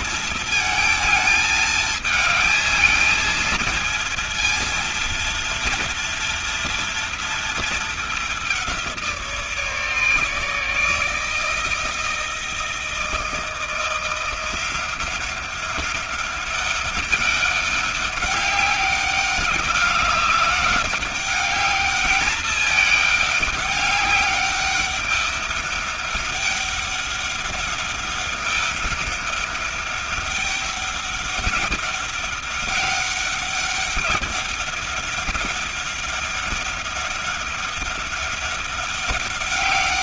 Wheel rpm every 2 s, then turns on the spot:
220, 220, 230, 230, 180, 150, 160, 180, 200, 200, 200, 210, 200, 200, 200, 200, 200, 200, 200, 200.
none